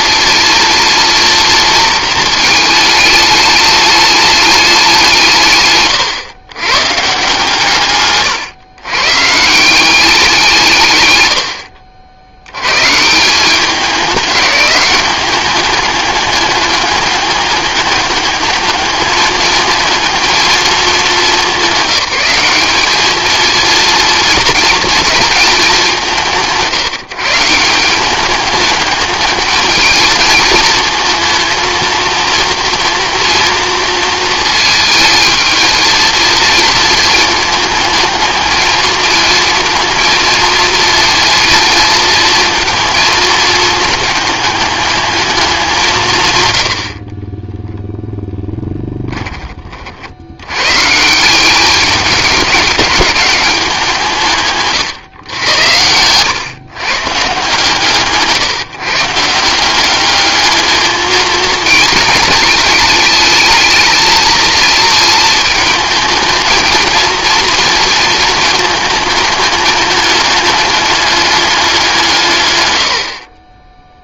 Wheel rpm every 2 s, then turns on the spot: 230, 220, 210, 120, 120, 180, 100, 200, 210, 200, 220, 190, 230, 180, 200, 220, 230, 230, 230, 220, 230, 230, 220, 140, 0, 80, 200, 160, 120, 150, 210, 210, 220, 220, 230, 210, 160.
none